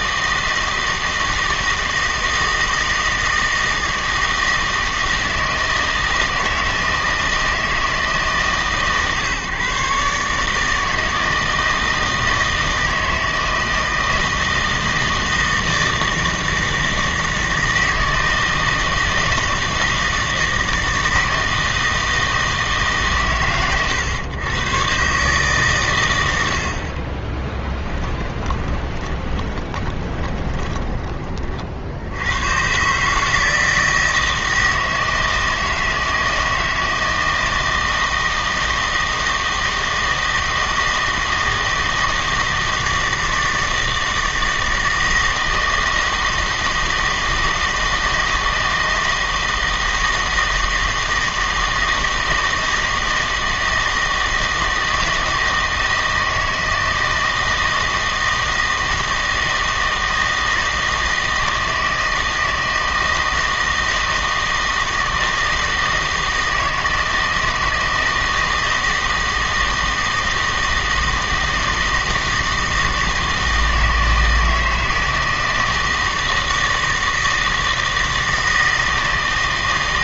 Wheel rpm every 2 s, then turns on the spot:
160, 160, 160, 160, 140, 150, 160, 160, 160, 160, 160, 160, 110, 70, 20, 20, 120, 160, 160, 160, 160, 160, 160, 160, 160, 160, 160, 160, 160, 160, 160, 160, 160, 160, 160, 160, 160, 160, 160, 160.
28-32